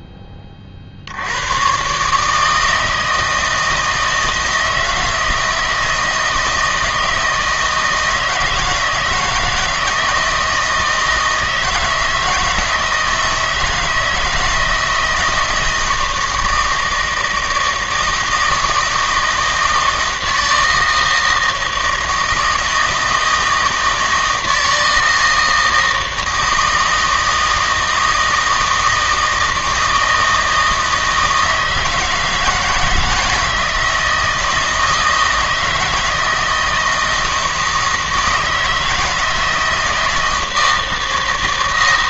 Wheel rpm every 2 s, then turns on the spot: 50, 160, 160, 160, 170, 170, 160, 160, 160, 160, 160, 160, 160, 160, 160, 160, 160, 160, 160, 160, 160.
none